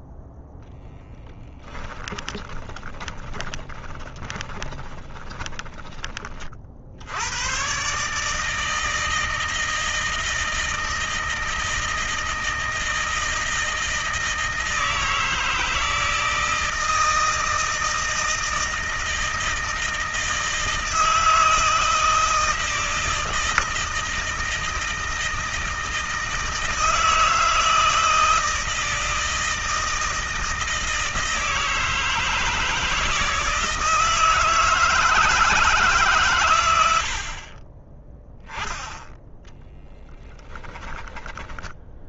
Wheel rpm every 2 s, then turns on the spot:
0, 20, 30, 60, 160, 160, 160, 160, 160, 160, 160, 160, 160, 160, 160, 160, 160, 160, 80, 10, 10.
2-6 40-42